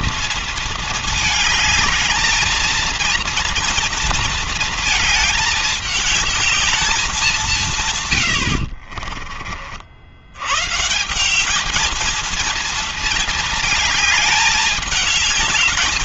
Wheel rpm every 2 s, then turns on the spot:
230, 220, 230, 210, 80, 110, 230, 220.
8-10